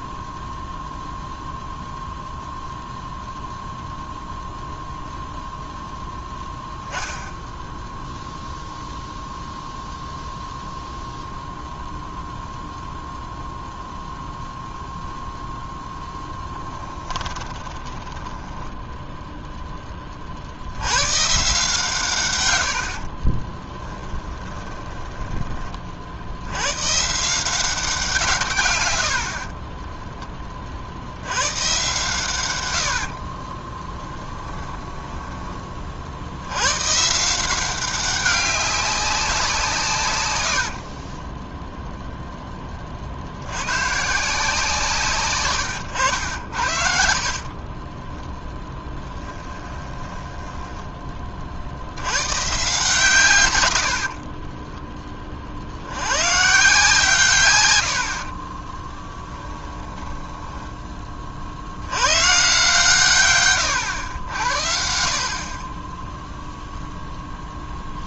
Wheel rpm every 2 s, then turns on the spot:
0, 0, 0, 0, 0, 0, 0, 0, 10, 10, 90, 90, 10, 120, 110, 60, 80, 10, 130, 200, 40, 60, 150, 60, 10, 10, 140, 20, 140, 10, 20, 140, 60, 0.
16-20 22-26 34-36 40-42 48-50 58-60